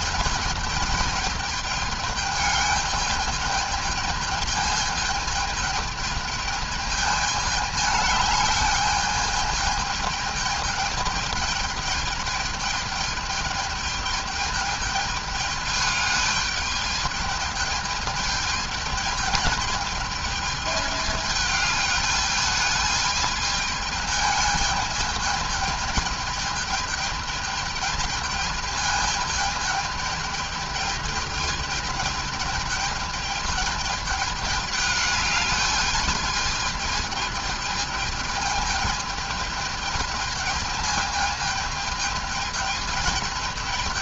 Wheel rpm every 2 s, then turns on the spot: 210, 210, 210, 220, 210, 220, 210, 210, 210, 210, 210, 210, 210, 220, 220, 210, 210, 210, 210, 210, 220, 210.
none